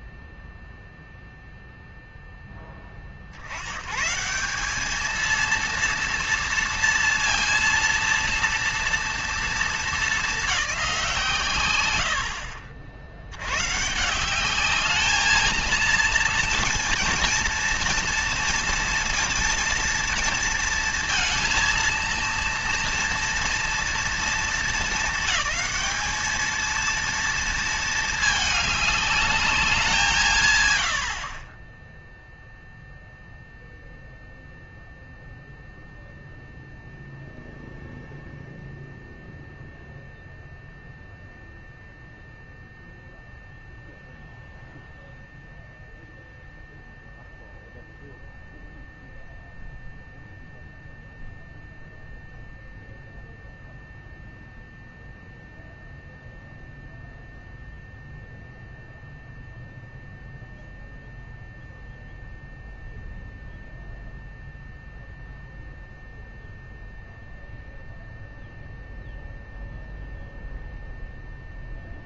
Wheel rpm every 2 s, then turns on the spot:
0, 20, 210, 230, 230, 190, 60, 200, 230, 230, 230, 230, 220, 230, 200, 120, 0, 0, 0, 0, 0, 0, 0, 0, 0, 0, 0, 0, 0, 0, 0, 0, 0, 0, 0, 0.
none